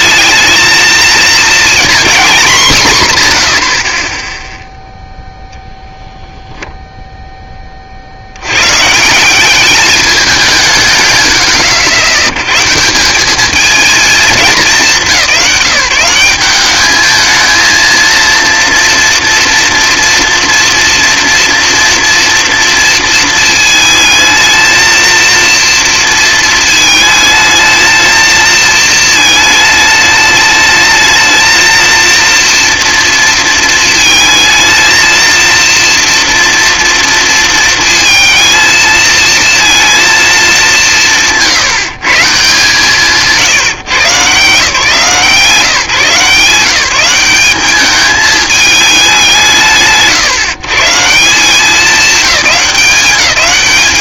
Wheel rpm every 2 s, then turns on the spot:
220, 240, 0, 0, 140, 160, 140, 170, 210, 230, 230, 230, 230, 220, 230, 220, 230, 220, 230, 230, 200, 160, 150, 180, 220, 150, 200.
none